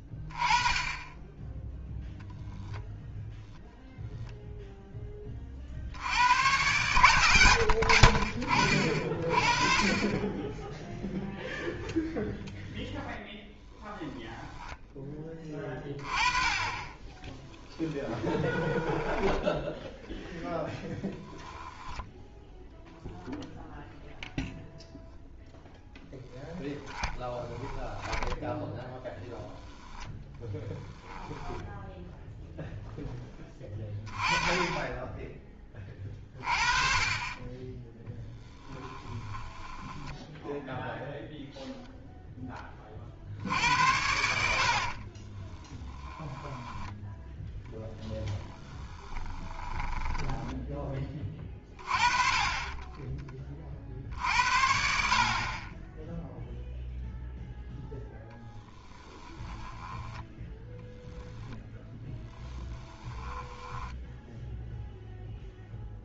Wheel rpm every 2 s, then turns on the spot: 10, 0, 0, 110, 40, 0, 0, 10, 20, 20, 20, 0, 0, 10, 10, 10, 0, 10, 30, 10, 0, 40, 60, 10, 10, 10, 20, 60, 0, 10, 10, 20, 0.
16-22 26-32 38-40 44-46 48-50 58-60 62-64